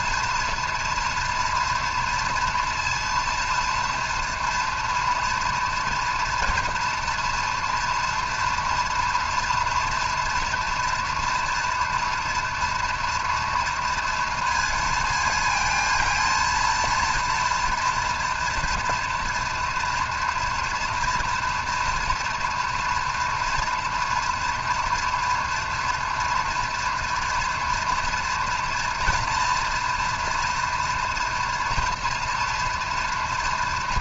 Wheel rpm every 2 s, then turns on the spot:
230, 230, 240, 230, 240, 230, 230, 230, 230, 230, 230, 230, 240, 230, 230, 240, 230.
none